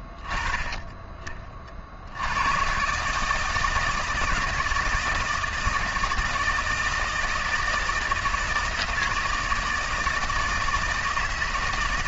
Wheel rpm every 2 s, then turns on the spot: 10, 100, 160, 160, 160, 160.
none